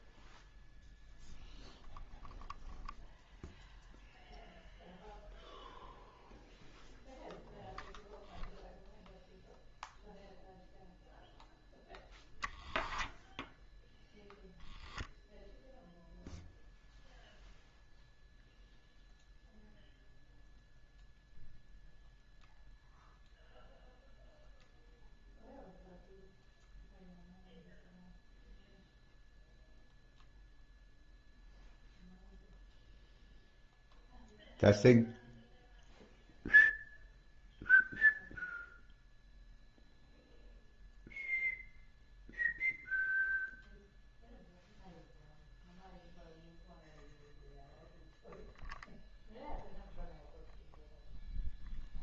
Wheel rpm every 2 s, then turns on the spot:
0, 0, 0, 0, 0, 0, 0, 0, 0, 0, 0, 0, 0, 0, 0, 0, 0, 0, 0, 0, 0, 0, 0, 0, 0, 0.
none